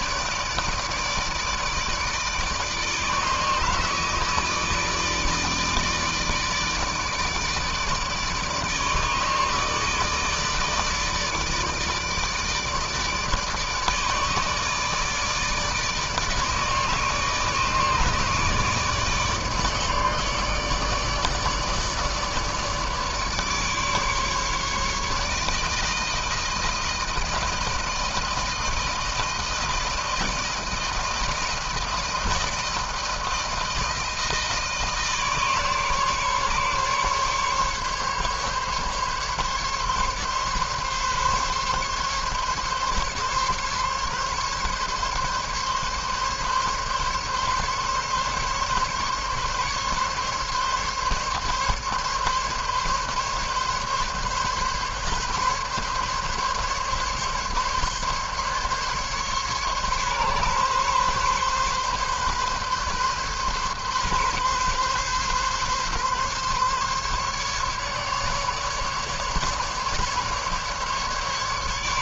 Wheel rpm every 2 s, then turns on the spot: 150, 160, 160, 160, 150, 150, 150, 150, 150, 160, 150, 150, 150, 160, 160, 160, 160, 160, 140, 140, 140, 140, 140, 140, 140, 140, 140, 140, 150, 140, 140, 140, 130, 140, 140, 150.
none